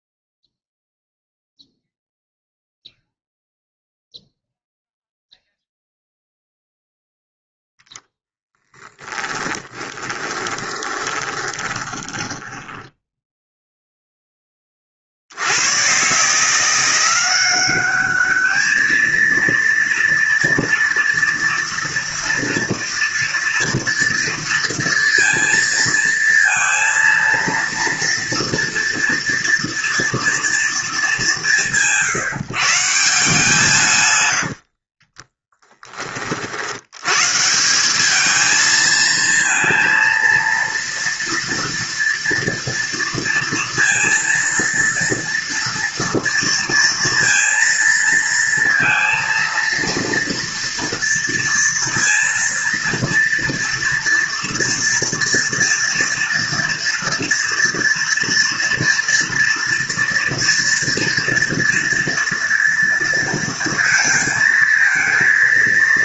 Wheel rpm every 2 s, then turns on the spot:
0, 0, 0, 0, 10, 20, 10, 30, 170, 220, 230, 230, 230, 230, 230, 200, 160, 50, 80, 220, 230, 230, 230, 230, 230, 230, 230, 230, 230, 230, 240, 230, 230.
8-14 34-36